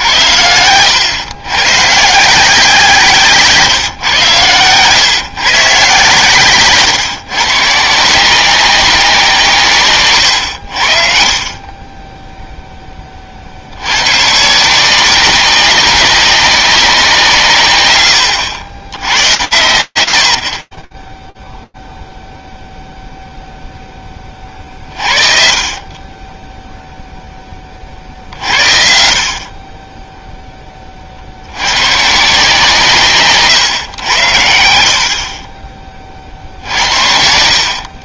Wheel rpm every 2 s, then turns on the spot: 80, 170, 120, 130, 180, 80, 10, 160, 190, 120, 10, 0, 40, 0, 60, 40, 140, 60, 50.
4-6